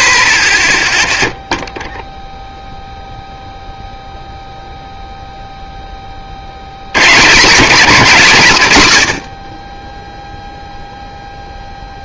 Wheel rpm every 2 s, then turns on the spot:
0, 0, 0, 90, 130, 0.
none